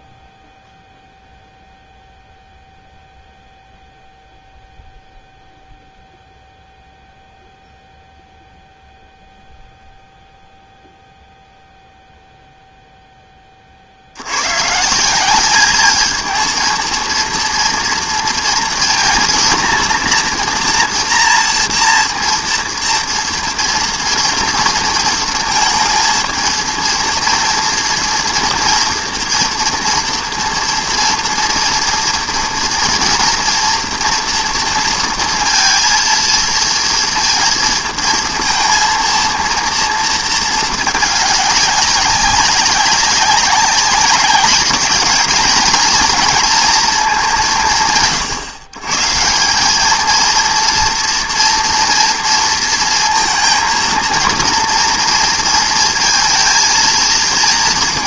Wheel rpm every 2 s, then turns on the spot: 0, 0, 0, 0, 0, 0, 0, 90, 220, 240, 230, 230, 230, 230, 230, 230, 240, 230, 230, 230, 230, 200, 190, 220, 150, 230, 230, 230, 230.
none